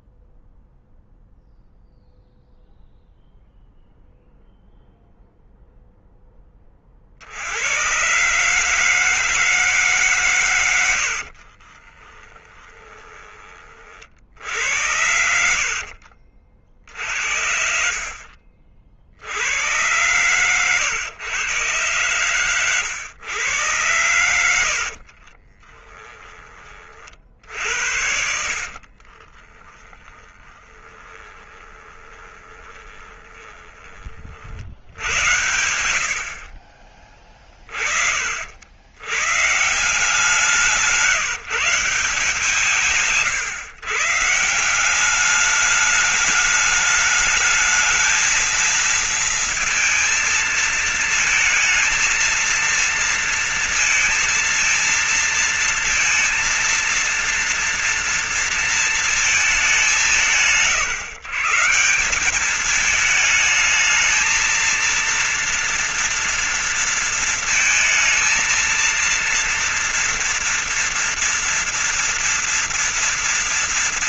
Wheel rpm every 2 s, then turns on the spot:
0, 0, 0, 10, 120, 140, 30, 50, 40, 50, 100, 120, 90, 20, 60, 10, 20, 40, 80, 40, 160, 160, 150, 210, 220, 230, 230, 230, 230, 230, 160, 180, 220, 230, 220, 230, 230.
12-14 16-20 26-34 40-42